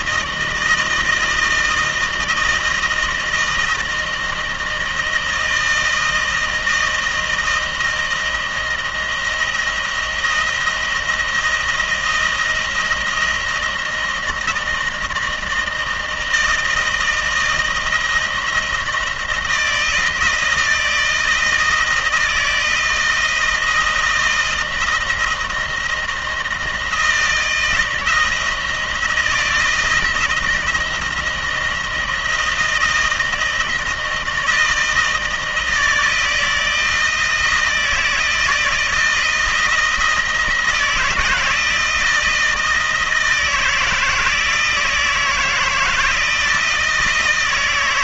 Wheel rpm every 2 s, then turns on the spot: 160, 160, 160, 160, 160, 160, 170, 160, 160, 160, 160, 160, 160, 160, 160, 160, 170, 170, 160, 160, 160, 160, 160, 160.
none